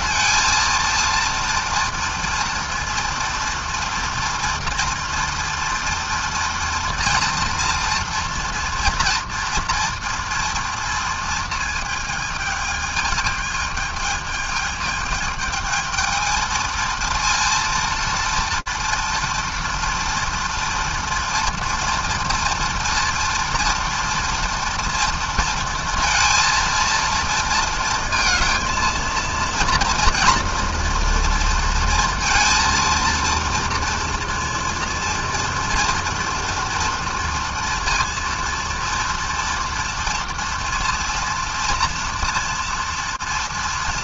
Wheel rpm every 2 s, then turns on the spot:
230, 230, 230, 230, 230, 230, 220, 210, 230, 230, 230, 230, 230, 230, 230, 230, 230, 230, 230, 230, 230, 230.
none